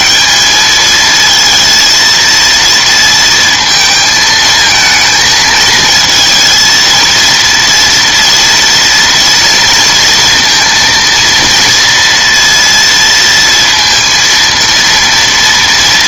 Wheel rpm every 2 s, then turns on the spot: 210, 230, 220, 230, 230, 230, 230, 230.
none